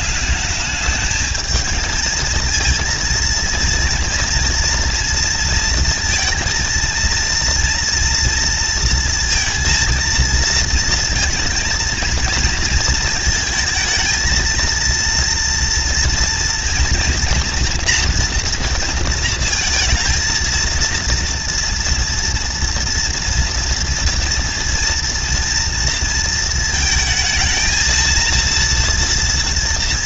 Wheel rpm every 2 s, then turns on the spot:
190, 220, 230, 230, 230, 230, 230, 230, 230, 230, 230, 230, 230, 230, 230.
none